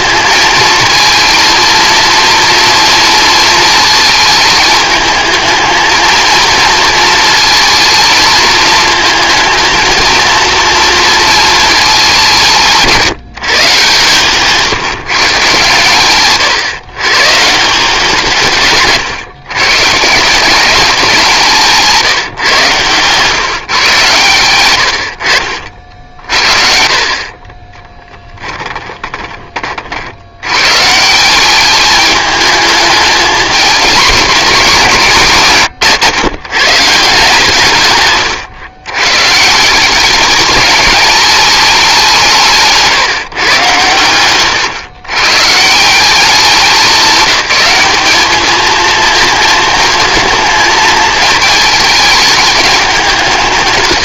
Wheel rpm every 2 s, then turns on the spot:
230, 230, 220, 220, 220, 230, 170, 140, 140, 150, 190, 130, 60, 50, 10, 130, 210, 190, 150, 110, 210, 150, 120, 200, 220, 220, 200.
26-30